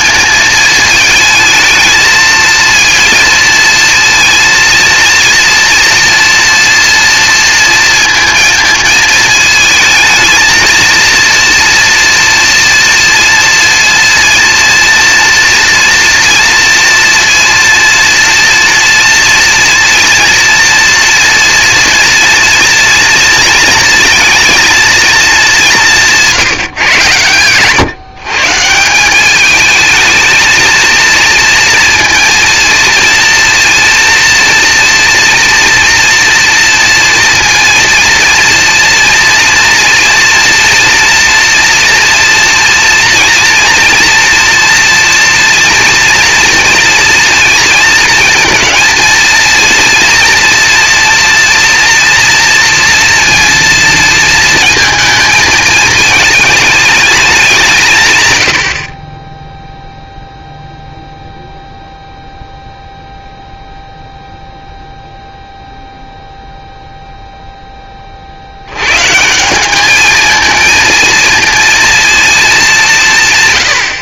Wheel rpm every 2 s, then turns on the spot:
220, 230, 230, 230, 220, 230, 230, 230, 230, 230, 230, 230, 230, 150, 150, 230, 230, 230, 230, 230, 230, 230, 230, 230, 230, 230, 230, 230, 220, 90, 0, 0, 0, 0, 90, 220, 200.
none